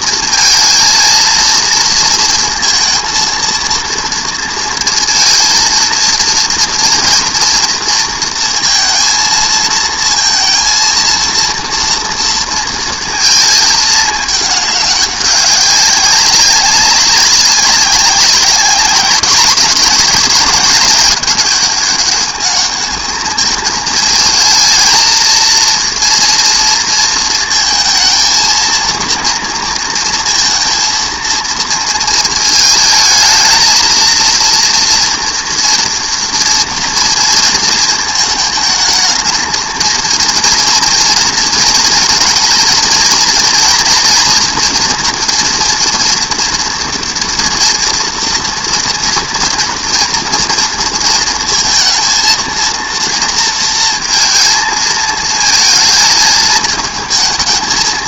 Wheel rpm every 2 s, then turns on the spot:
230, 230, 230, 230, 230, 230, 230, 210, 190, 200, 200, 210, 220, 230, 230, 230, 220, 230, 230, 220, 230, 220, 240, 230, 230, 230, 230, 220, 220.
none